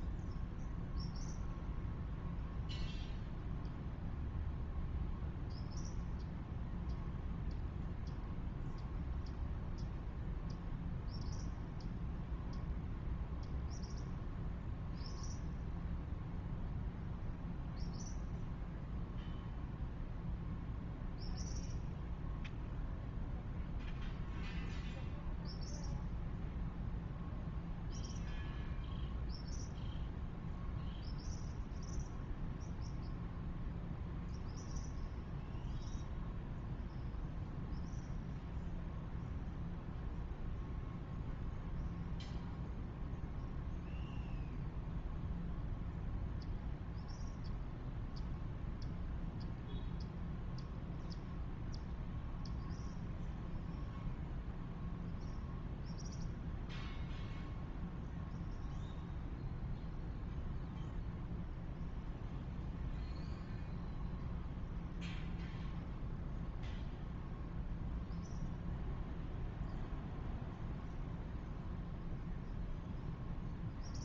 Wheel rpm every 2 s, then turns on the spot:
0, 0, 0, 0, 0, 0, 0, 0, 0, 0, 0, 0, 0, 0, 0, 0, 0, 0, 0, 0, 0, 0, 0, 0, 0, 0, 0, 0, 0, 0, 0, 0, 0, 0, 0, 0, 0.
none